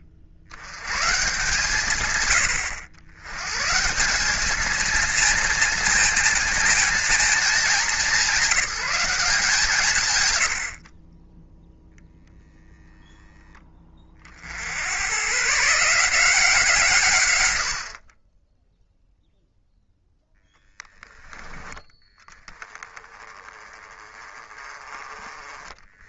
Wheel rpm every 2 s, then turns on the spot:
80, 100, 210, 230, 200, 50, 0, 70, 160, 10, 10, 20, 20.
none